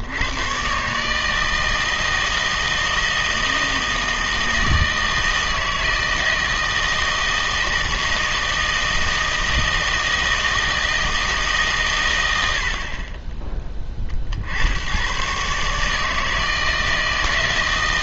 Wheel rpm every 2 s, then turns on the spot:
130, 160, 160, 160, 160, 160, 60, 80, 160.
none